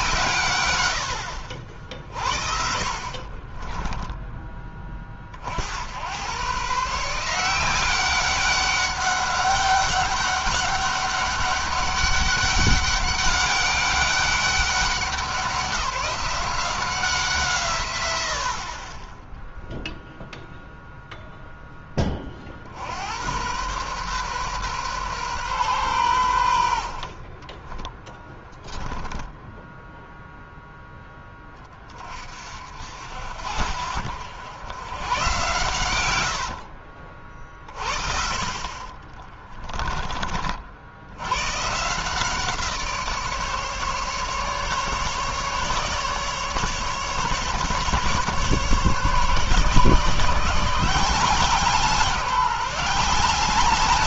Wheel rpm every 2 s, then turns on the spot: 100, 50, 30, 140, 200, 200, 200, 200, 180, 30, 0, 60, 130, 80, 10, 0, 50, 90, 80, 50, 60, 160, 150, 140, 140, 170, 180.
2-4 28-30 36-40